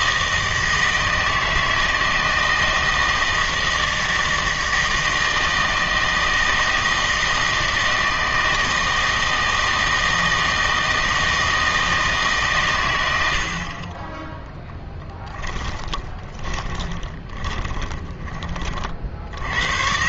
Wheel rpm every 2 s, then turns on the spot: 160, 160, 160, 160, 160, 160, 110, 10, 20, 40.
14-18